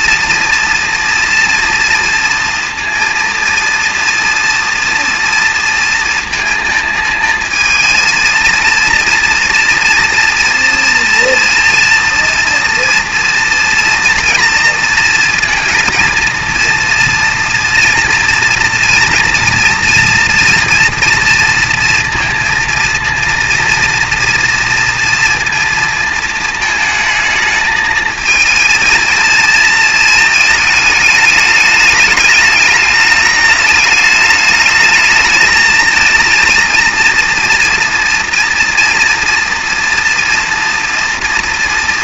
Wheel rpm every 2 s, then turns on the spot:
240, 230, 230, 230, 230, 230, 230, 230, 230, 230, 230, 230, 230, 220, 230, 220, 210, 210, 230, 230, 230.
none